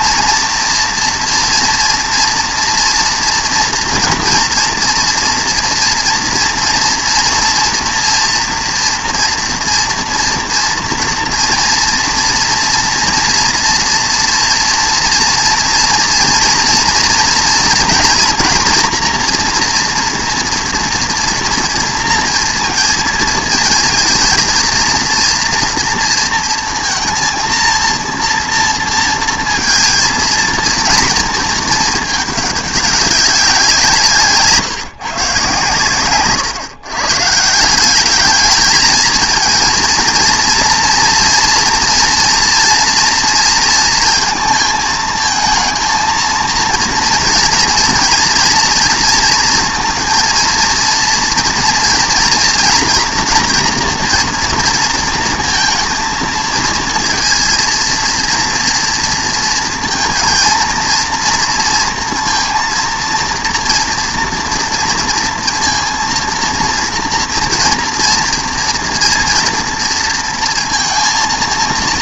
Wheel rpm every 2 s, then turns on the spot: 230, 230, 230, 230, 230, 230, 230, 230, 230, 230, 230, 230, 230, 230, 230, 230, 200, 160, 130, 230, 230, 230, 220, 230, 230, 230, 230, 230, 230, 230, 220, 230, 230, 230, 230, 230.
none